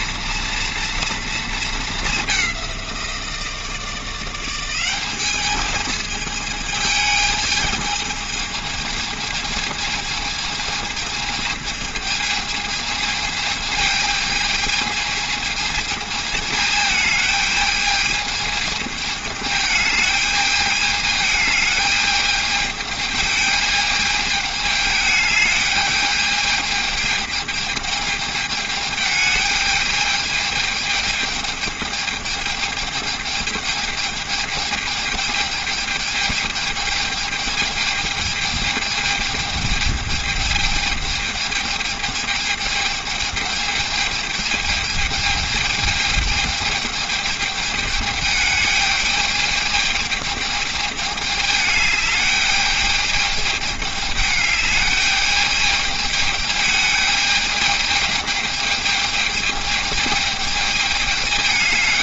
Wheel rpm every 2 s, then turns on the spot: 230, 180, 200, 220, 220, 220, 220, 220, 220, 210, 210, 220, 210, 210, 210, 210, 210, 210, 210, 210, 210, 210, 220, 210, 210, 210, 210, 210, 220, 220, 220.
none